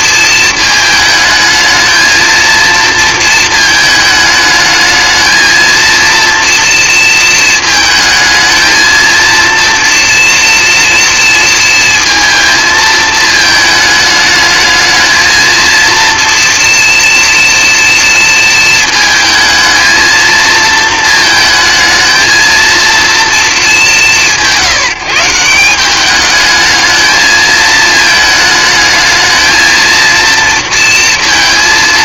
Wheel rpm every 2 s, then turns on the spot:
220, 230, 220, 220, 230, 230, 220, 220, 230, 220, 230, 230, 170, 220, 220, 230.
none